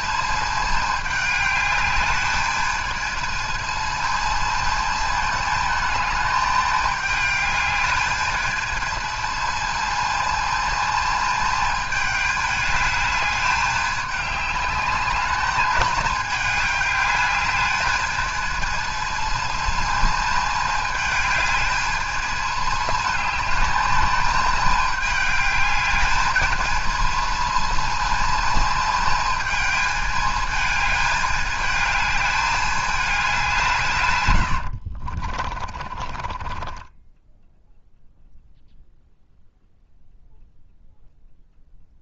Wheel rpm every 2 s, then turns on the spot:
220, 220, 230, 210, 220, 220, 210, 210, 210, 220, 220, 220, 210, 220, 220, 220, 210, 70, 20, 0, 0.
34-36